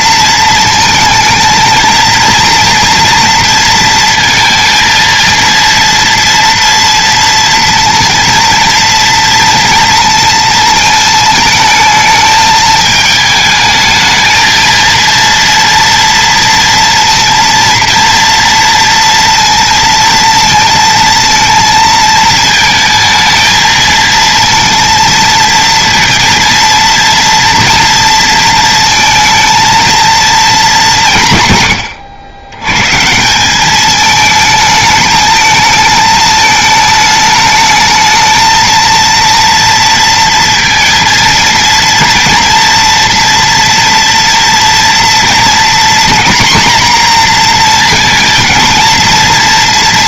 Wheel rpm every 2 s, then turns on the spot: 230, 230, 230, 230, 230, 220, 220, 230, 230, 230, 230, 230, 230, 230, 230, 190, 130, 220, 220, 230, 230, 230, 230, 240, 230.
none